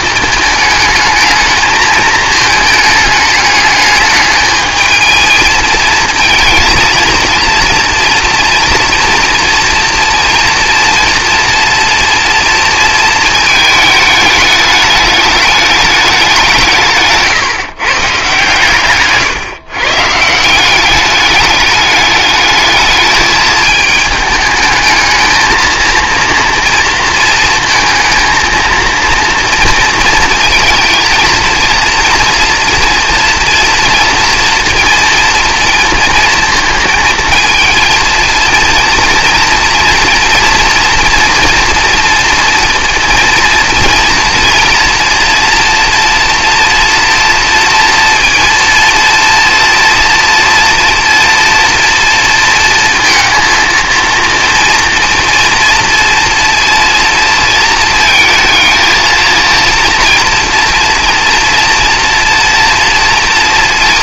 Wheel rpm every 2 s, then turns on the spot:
220, 220, 210, 220, 230, 230, 230, 210, 190, 140, 160, 210, 220, 230, 230, 230, 230, 230, 230, 230, 240, 230, 230, 230, 230, 230, 230, 230, 230, 230, 230, 230.
none